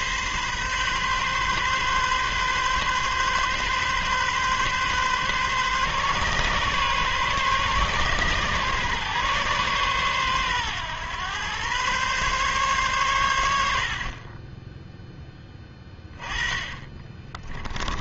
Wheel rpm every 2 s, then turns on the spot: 130, 130, 130, 130, 130, 120, 120, 10, 20.
14-18